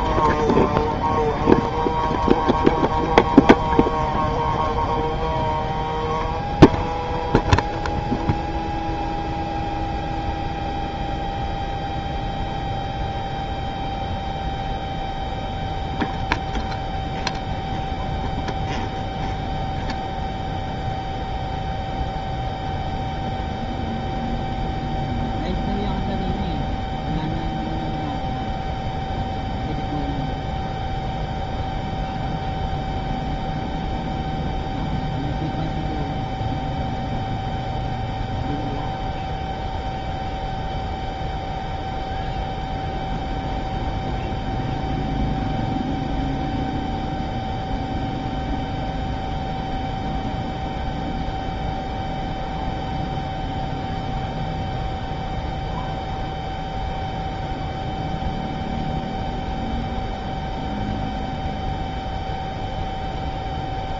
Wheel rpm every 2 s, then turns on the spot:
0, 0, 0, 0, 0, 0, 0, 0, 0, 0, 0, 0, 0, 0, 0, 0, 0, 0, 0, 0, 0, 0, 0, 0, 0, 0, 0, 0, 0, 0, 0, 0.
none